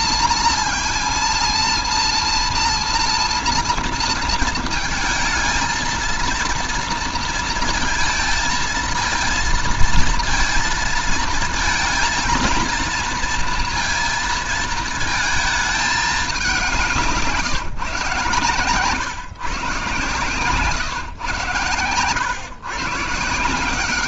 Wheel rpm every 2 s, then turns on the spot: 230, 230, 230, 230, 220, 230, 230, 220, 170, 130, 120, 120.
none